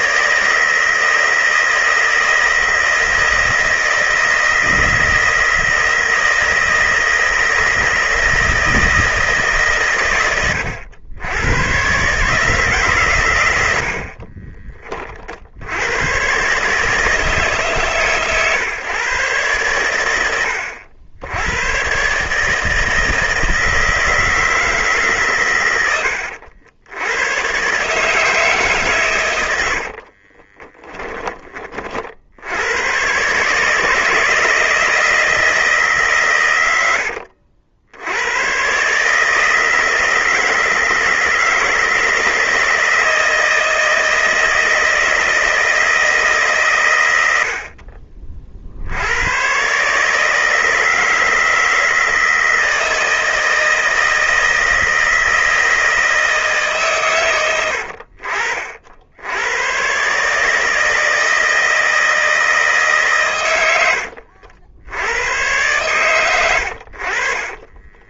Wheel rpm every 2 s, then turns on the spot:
160, 160, 160, 160, 160, 100, 140, 30, 150, 130, 80, 160, 160, 80, 140, 20, 100, 160, 90, 130, 160, 160, 160, 130, 60, 160, 160, 160, 140, 60, 160, 150, 80, 90.
30-32 36-38